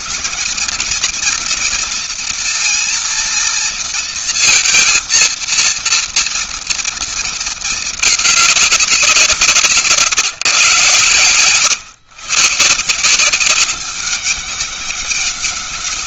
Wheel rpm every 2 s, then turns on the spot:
220, 230, 230, 230, 200, 130, 140, 200.
none